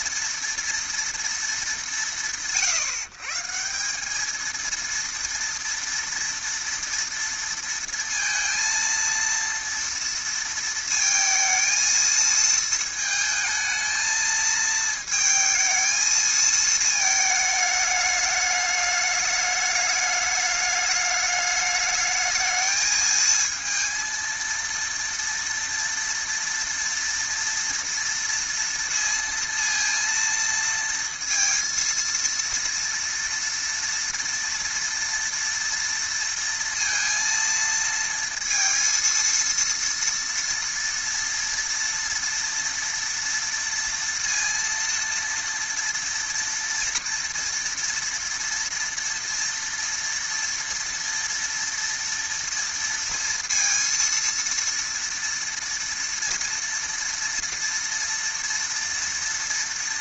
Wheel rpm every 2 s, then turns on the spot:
230, 120, 210, 230, 230, 230, 220, 220, 220, 210, 210, 210, 230, 230, 230, 230, 230, 230, 230, 230, 230, 230, 230, 230, 230, 230, 230, 230, 230, 230.
none